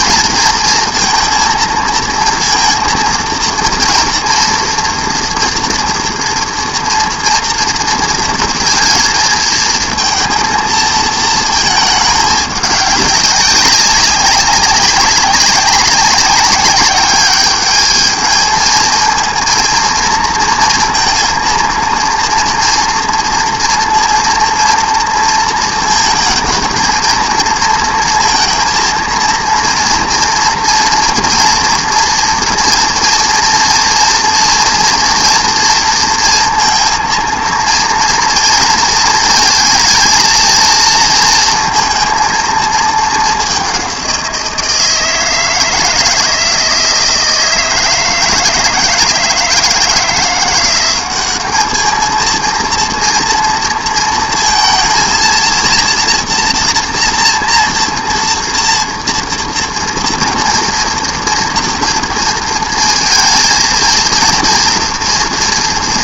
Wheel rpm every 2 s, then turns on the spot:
230, 230, 230, 230, 230, 220, 200, 200, 200, 220, 230, 230, 230, 230, 230, 230, 230, 230, 230, 230, 230, 220, 170, 160, 160, 180, 230, 230, 230, 230, 230, 230, 230.
none